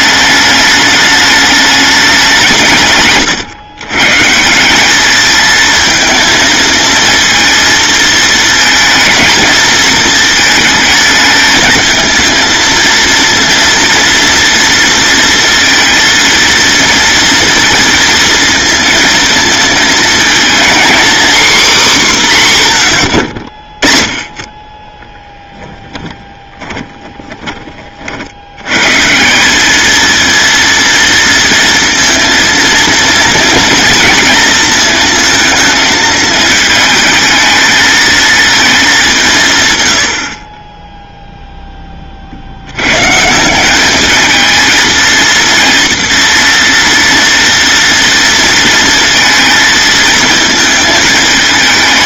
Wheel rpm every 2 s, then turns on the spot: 210, 130, 200, 230, 220, 220, 230, 230, 230, 220, 240, 100, 10, 30, 140, 230, 230, 220, 220, 200, 10, 110, 230, 240, 230, 220.
24-28